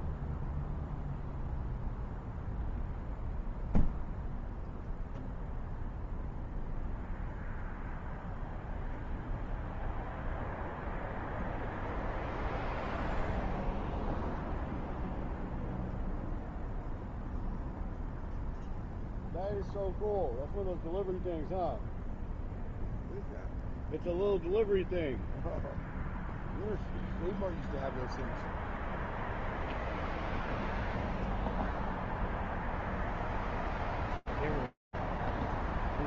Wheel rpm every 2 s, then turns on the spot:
0, 0, 0, 0, 0, 0, 0, 0, 0, 0, 0, 0, 0, 0, 0, 0, 0, 0.
none